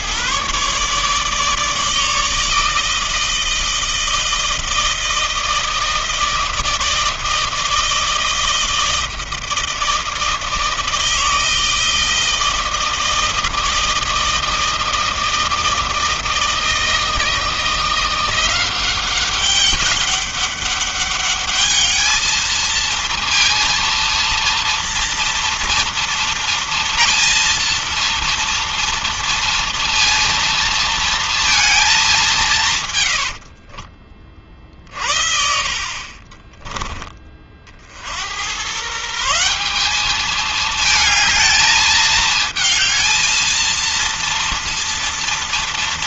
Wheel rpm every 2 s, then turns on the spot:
150, 160, 160, 160, 160, 160, 160, 160, 160, 190, 200, 230, 230, 230, 230, 230, 110, 50, 30, 150, 220, 220, 230.
32-34